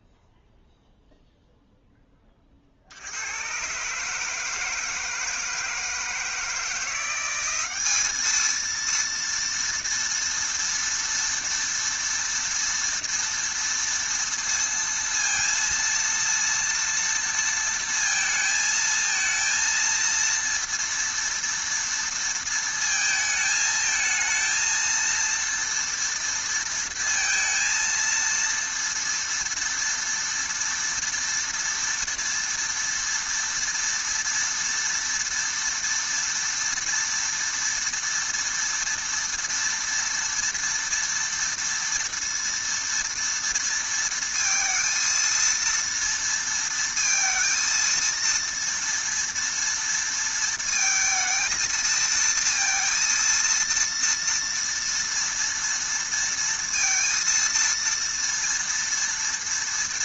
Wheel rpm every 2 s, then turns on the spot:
0, 90, 160, 180, 230, 230, 230, 230, 230, 230, 230, 220, 230, 230, 230, 230, 230, 240, 230, 230, 230, 230, 230, 230, 230, 220, 230, 230, 230, 230.
none